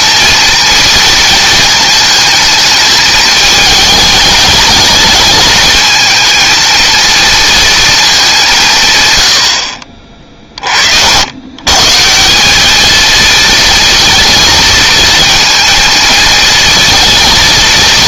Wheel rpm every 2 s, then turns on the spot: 230, 220, 220, 220, 150, 50, 220, 230, 230.
none